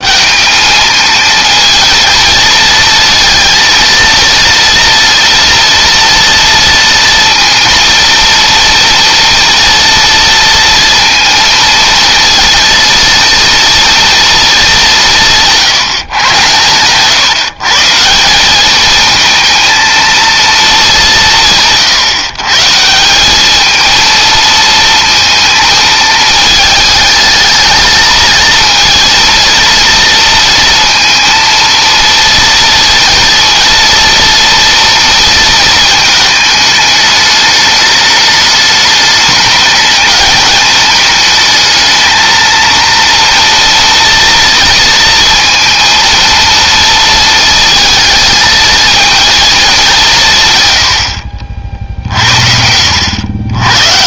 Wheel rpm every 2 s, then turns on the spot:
220, 230, 230, 230, 230, 230, 230, 180, 120, 210, 200, 160, 230, 220, 230, 230, 230, 230, 210, 210, 210, 230, 230, 230, 220, 100, 80.
none